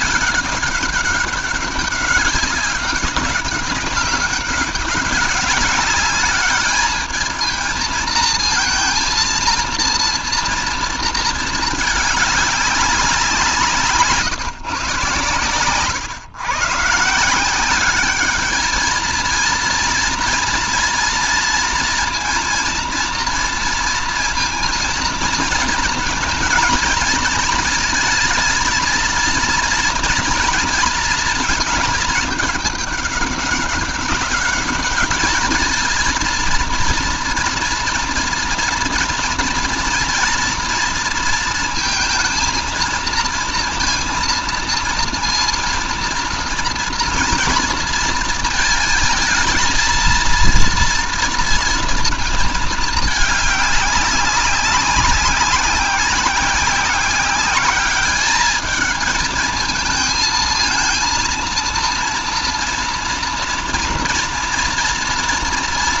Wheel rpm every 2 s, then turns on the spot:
200, 200, 200, 220, 230, 230, 180, 130, 160, 230, 230, 230, 230, 230, 230, 230, 200, 210, 230, 230, 230, 230, 230, 230, 220, 230, 210, 190, 190, 220, 230, 230, 230.
none